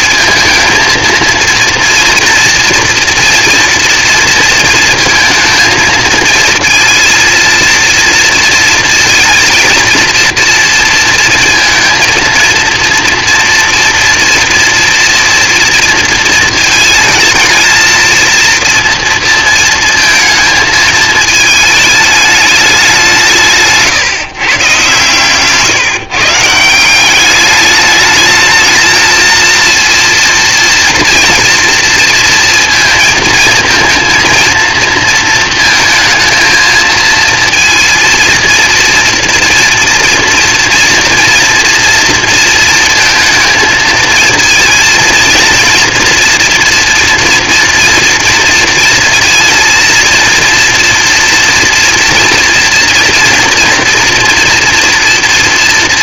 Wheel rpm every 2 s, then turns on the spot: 230, 230, 230, 230, 230, 240, 230, 230, 220, 230, 220, 200, 130, 170, 220, 230, 230, 230, 220, 230, 230, 230, 230, 240, 230, 230, 230, 230.
none